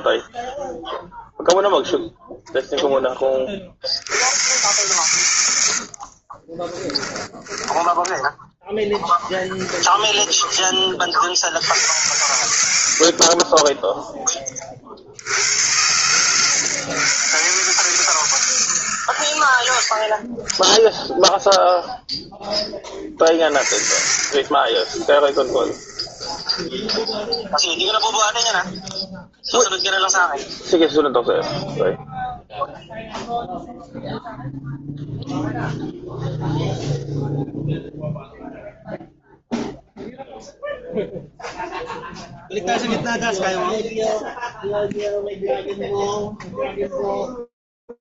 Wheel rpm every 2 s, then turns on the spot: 60, 50, 10, 10, 80, 20, 100, 140, 80, 0, 40, 20, 20, 10, 0, 0, 0, 0, 0, 0, 0, 0, 0, 20.
2-4 6-8 10-12 20-28 46-48